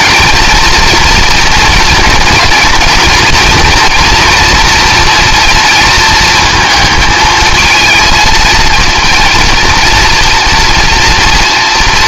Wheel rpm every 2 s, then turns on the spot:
230, 240, 240, 220, 230, 240.
none